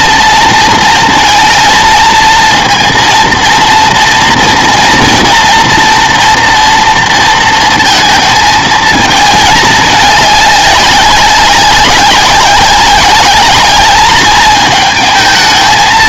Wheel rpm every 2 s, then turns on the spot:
220, 230, 230, 230, 220, 200, 200, 220.
none